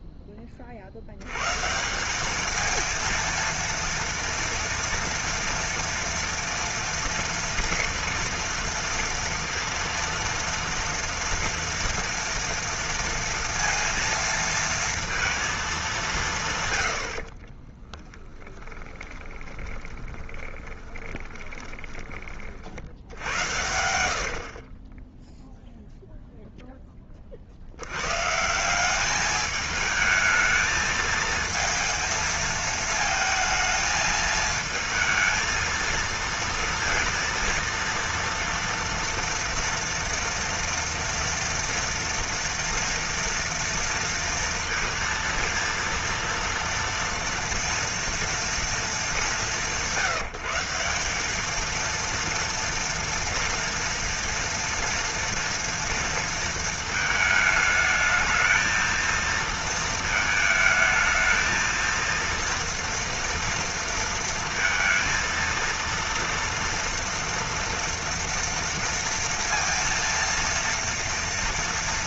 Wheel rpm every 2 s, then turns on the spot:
40, 220, 230, 230, 230, 230, 230, 230, 130, 20, 20, 50, 40, 0, 180, 220, 220, 220, 230, 230, 230, 230, 230, 230, 230, 180, 230, 230, 230, 220, 220, 230, 230, 230, 230, 230.
18-22 24-26